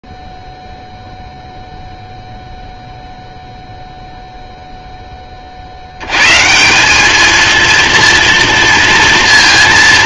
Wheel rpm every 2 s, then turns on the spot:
0, 0, 0, 130, 230.
none